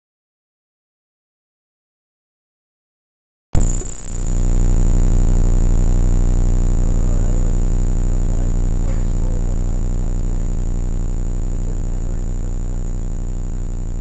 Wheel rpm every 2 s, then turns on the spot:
0, 0, 0, 0, 0, 0, 0.
none